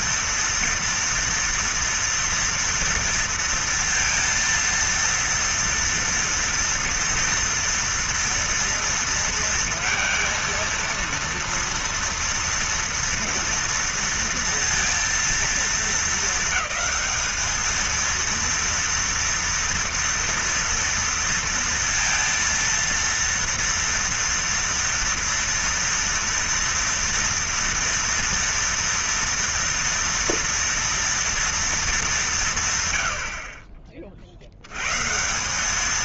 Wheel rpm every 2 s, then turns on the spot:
240, 230, 230, 230, 230, 230, 230, 230, 220, 230, 230, 230, 230, 230, 230, 230, 160, 80.
none